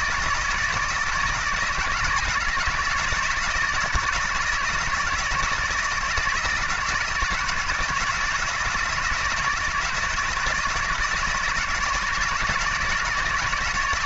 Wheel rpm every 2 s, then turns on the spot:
160, 160, 160, 170, 160, 160, 160.
none